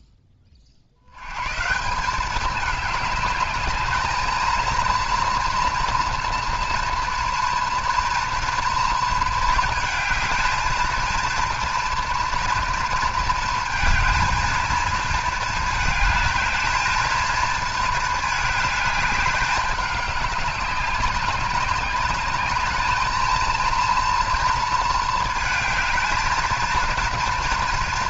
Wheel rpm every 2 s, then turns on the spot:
40, 210, 230, 230, 230, 220, 230, 220, 220, 210, 200, 210, 220, 230.
none